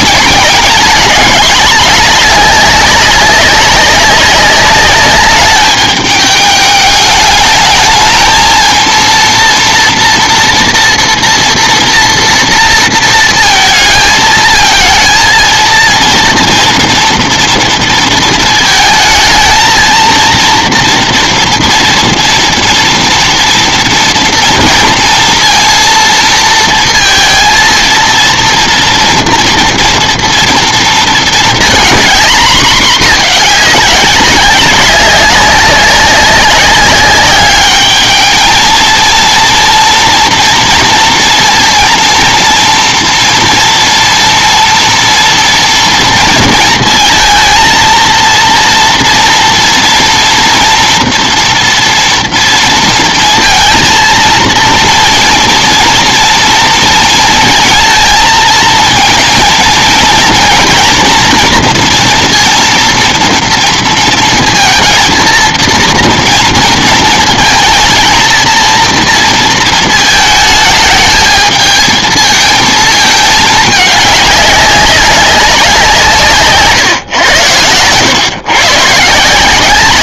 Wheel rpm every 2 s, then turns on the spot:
210, 190, 200, 210, 230, 230, 230, 220, 230, 220, 230, 230, 230, 220, 230, 230, 220, 200, 200, 230, 240, 230, 230, 220, 230, 240, 230, 230, 230, 220, 230, 230, 220, 230, 230, 220, 220, 200, 120, 150.
none